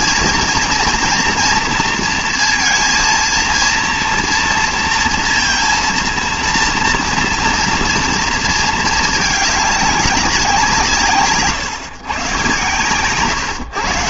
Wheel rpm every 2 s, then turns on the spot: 230, 230, 230, 230, 220, 180, 120.
none